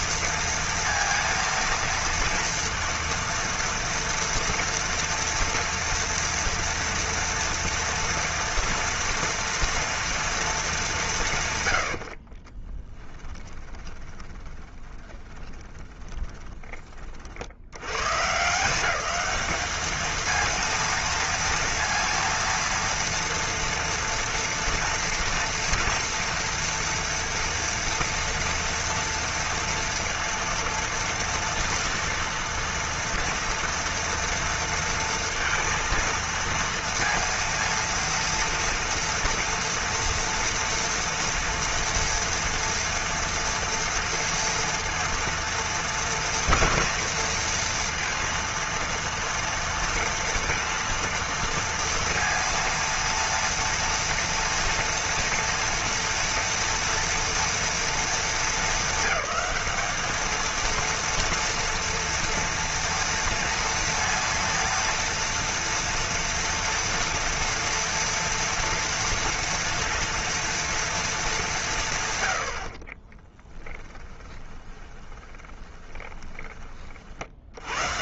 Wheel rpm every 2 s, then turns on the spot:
230, 230, 230, 240, 230, 230, 40, 20, 20, 140, 230, 230, 240, 230, 230, 230, 230, 230, 230, 230, 230, 230, 230, 230, 230, 230, 230, 230, 230, 220, 220, 230, 230, 230, 230, 230, 100, 20, 20.
12-18 74-76